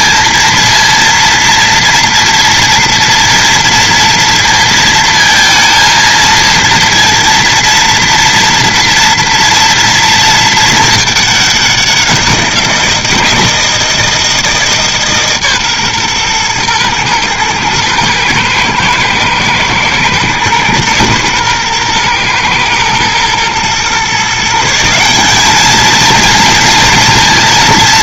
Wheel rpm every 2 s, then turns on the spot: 230, 230, 230, 230, 230, 220, 170, 150, 120, 110, 120, 120, 170, 230.
none